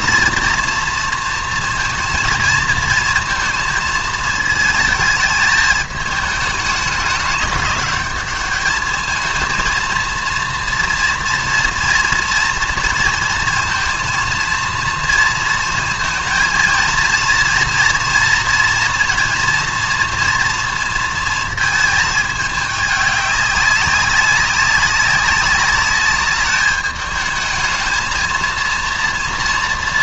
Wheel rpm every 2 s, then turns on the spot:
230, 230, 220, 210, 210, 230, 230, 230, 230, 230, 230, 210, 200, 210, 230.
none